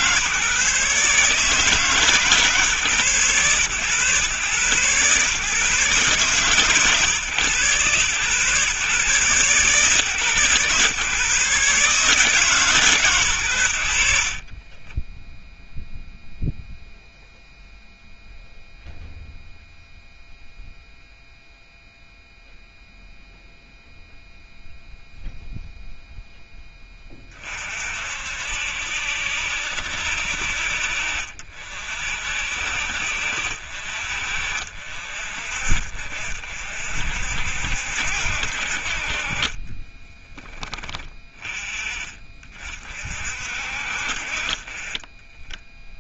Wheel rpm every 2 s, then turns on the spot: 140, 140, 120, 130, 130, 130, 150, 30, 0, 0, 0, 0, 0, 10, 60, 60, 60, 50, 50, 60, 20, 30, 30.
14-16